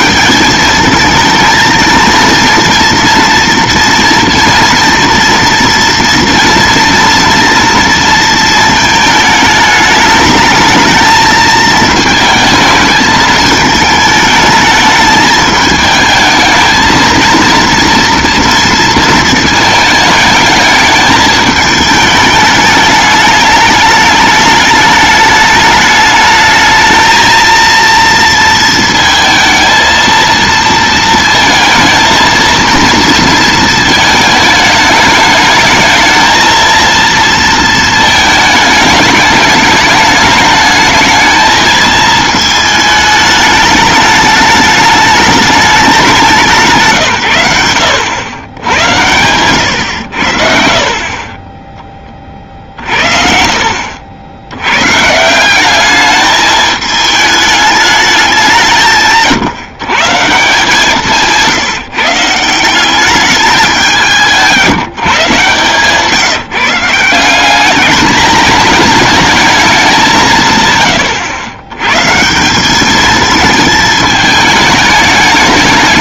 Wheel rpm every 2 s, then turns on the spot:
200, 230, 230, 230, 220, 220, 220, 220, 220, 230, 220, 210, 210, 220, 230, 230, 230, 220, 230, 220, 210, 220, 210, 160, 90, 50, 40, 100, 210, 180, 160, 160, 170, 160, 210, 130, 180, 220.
none